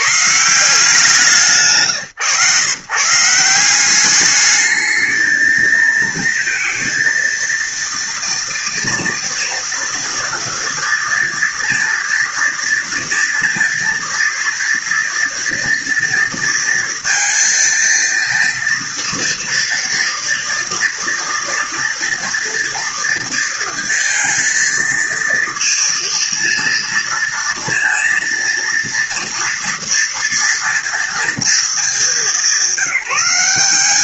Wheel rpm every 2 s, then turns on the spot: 170, 130, 210, 230, 230, 230, 230, 230, 230, 230, 230, 230, 230, 230, 230, 230, 190.
none